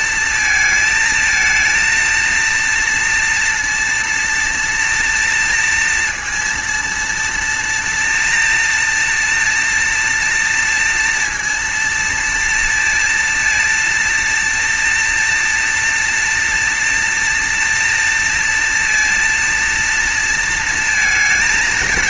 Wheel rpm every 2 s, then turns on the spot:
220, 230, 230, 230, 230, 230, 230, 230, 230, 230, 230.
none